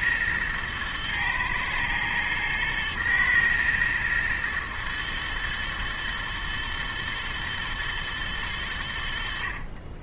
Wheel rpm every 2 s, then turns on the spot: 110, 110, 110, 110, 90.
none